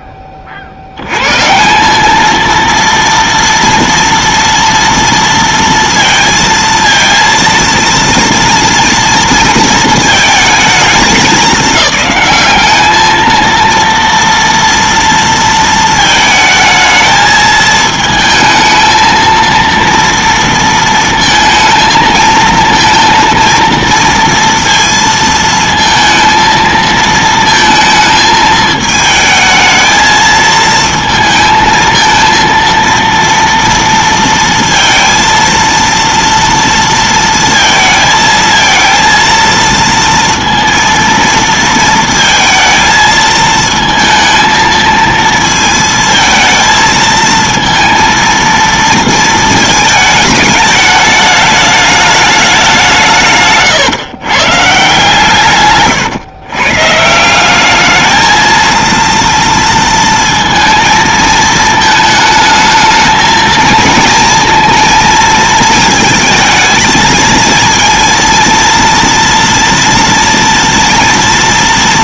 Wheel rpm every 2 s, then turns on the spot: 90, 230, 230, 230, 230, 220, 210, 230, 220, 220, 230, 230, 230, 220, 220, 220, 230, 230, 230, 230, 230, 220, 230, 220, 230, 210, 180, 150, 130, 230, 220, 220, 230, 220, 230, 230.
none